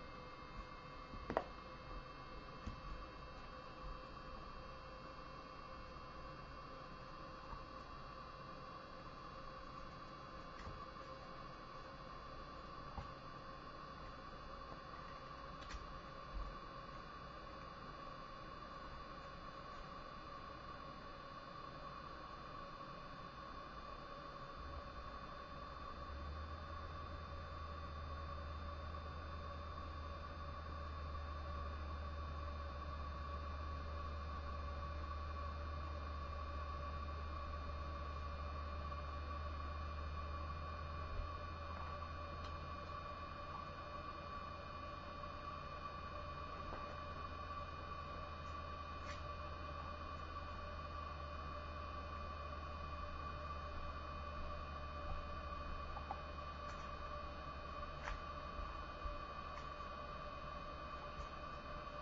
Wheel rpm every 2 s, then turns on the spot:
0, 0, 0, 0, 0, 0, 0, 0, 0, 0, 0, 0, 0, 0, 0, 0, 0, 0, 0, 0, 0, 0, 0, 0, 0, 0, 0, 0, 0, 0, 0.
none